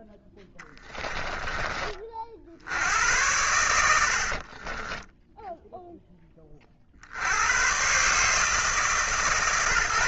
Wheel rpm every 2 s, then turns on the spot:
10, 70, 30, 40, 150.
0-2 4-6